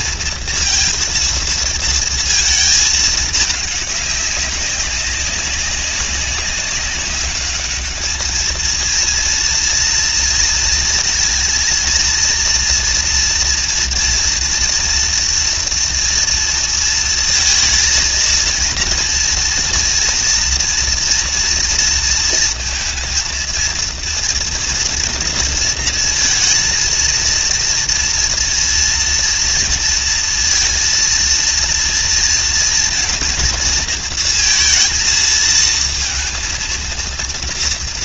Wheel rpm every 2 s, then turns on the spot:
230, 220, 200, 200, 220, 230, 230, 230, 230, 230, 230, 230, 230, 230, 230, 230, 230, 230, 230.
none